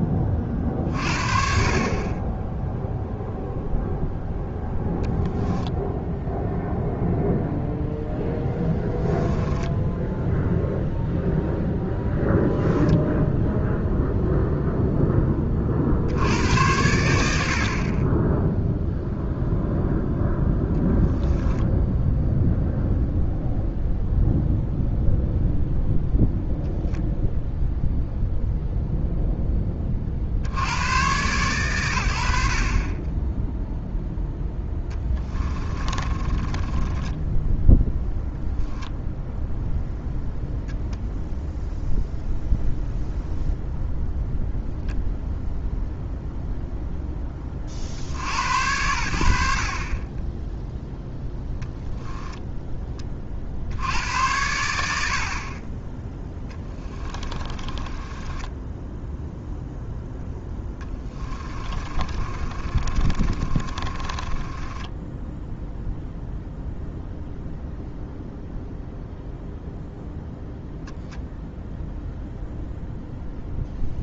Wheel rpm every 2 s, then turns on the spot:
50, 0, 0, 0, 10, 0, 0, 0, 90, 0, 0, 0, 0, 0, 0, 90, 30, 10, 20, 0, 0, 0, 0, 0, 80, 10, 20, 60, 10, 10, 10, 30, 10, 0, 0, 0, 0.
8-10 34-38 56-66